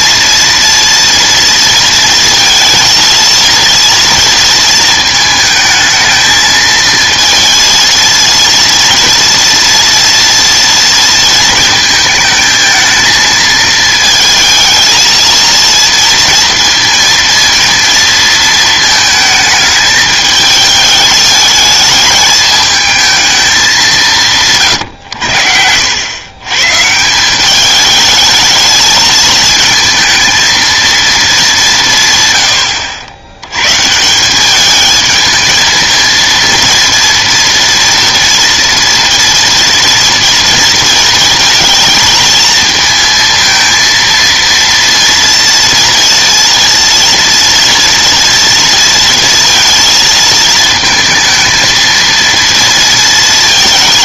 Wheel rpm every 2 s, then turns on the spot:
230, 230, 230, 220, 230, 240, 220, 220, 230, 220, 210, 220, 140, 130, 220, 220, 110, 200, 230, 230, 230, 220, 230, 230, 230, 220, 230.
none